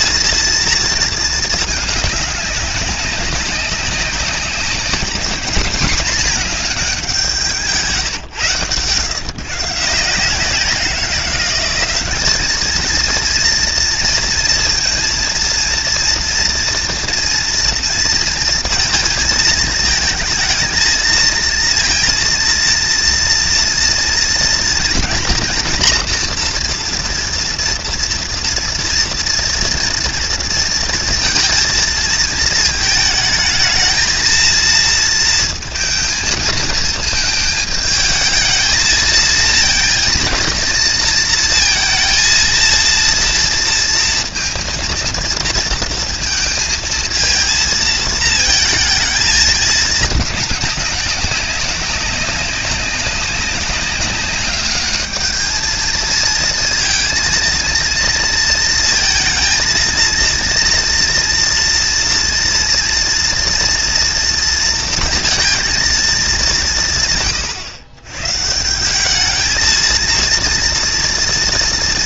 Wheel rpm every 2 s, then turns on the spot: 230, 200, 190, 210, 130, 180, 210, 230, 240, 230, 220, 230, 230, 230, 230, 230, 220, 230, 220, 220, 230, 230, 230, 230, 220, 210, 190, 200, 230, 230, 230, 230, 230, 180, 150, 230.
none